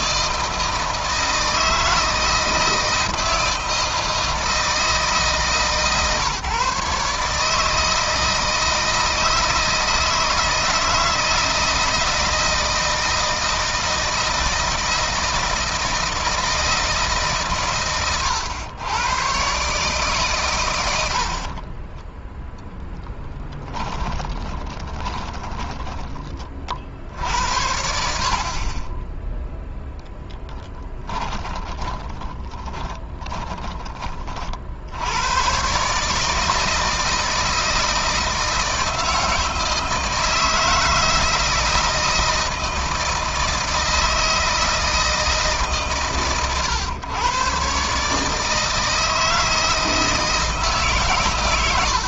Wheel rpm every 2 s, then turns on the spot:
160, 160, 160, 140, 160, 160, 160, 160, 150, 110, 100, 0, 20, 50, 30, 10, 10, 70, 160, 160, 160, 160, 160, 110, 160, 140.
24-26 30-34